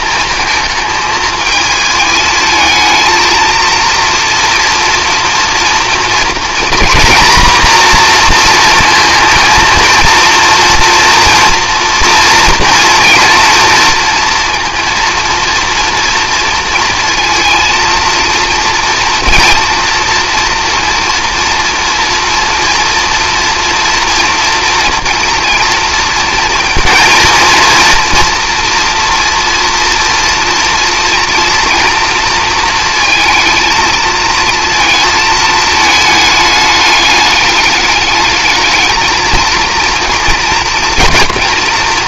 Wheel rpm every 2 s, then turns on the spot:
220, 220, 240, 230, 230, 230, 230, 230, 230, 230, 230, 230, 230, 230, 230, 230, 230, 220, 210, 220, 230.
none